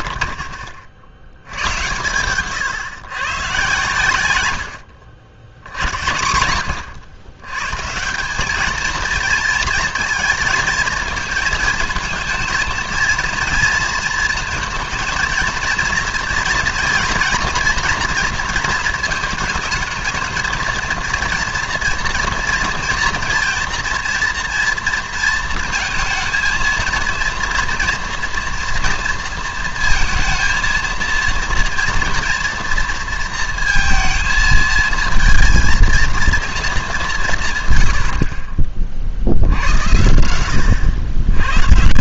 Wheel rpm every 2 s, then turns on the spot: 70, 140, 80, 100, 210, 220, 230, 230, 240, 230, 230, 230, 230, 230, 240, 230, 230, 220, 220, 40, 90.
none